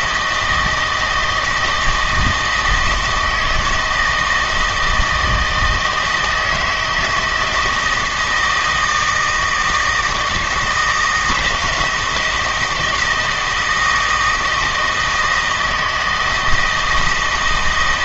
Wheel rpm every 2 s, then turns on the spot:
160, 160, 160, 160, 160, 160, 170, 160, 160.
none